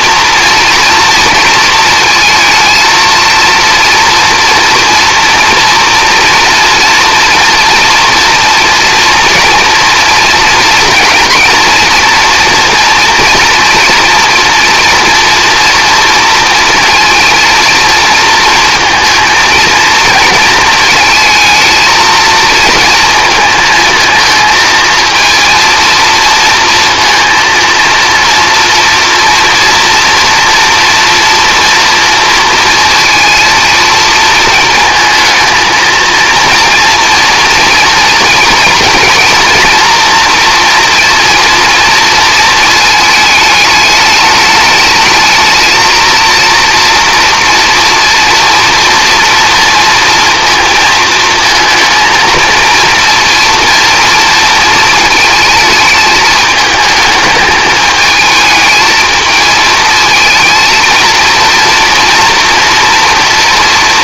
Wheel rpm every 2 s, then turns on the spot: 230, 230, 240, 230, 240, 230, 230, 230, 230, 230, 220, 230, 220, 230, 230, 230, 230, 220, 230, 240, 240, 220, 210, 230, 230, 230, 230, 230, 220, 220, 230, 230.
none